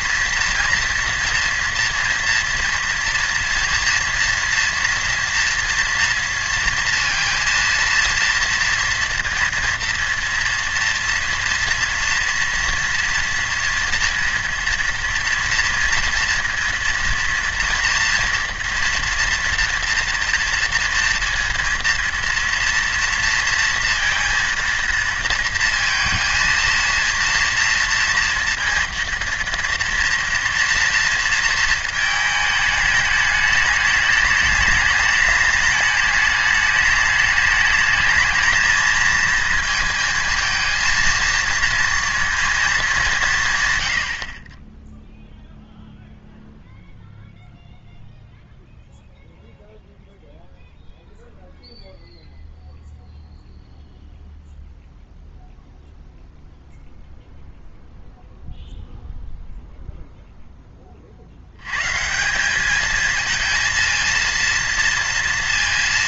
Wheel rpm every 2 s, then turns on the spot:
230, 230, 230, 230, 230, 230, 230, 240, 230, 230, 230, 240, 230, 220, 230, 230, 210, 210, 210, 220, 230, 220, 30, 0, 0, 0, 0, 0, 0, 0, 10, 190, 230.
none